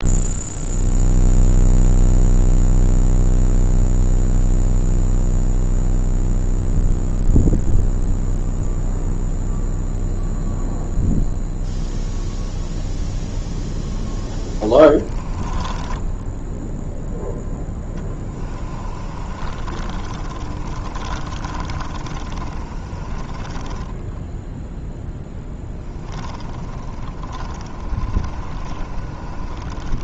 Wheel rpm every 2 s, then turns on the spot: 0, 0, 0, 0, 0, 0, 0, 20, 10, 40, 30, 30, 10, 30, 30.
14-16 18-24 26-30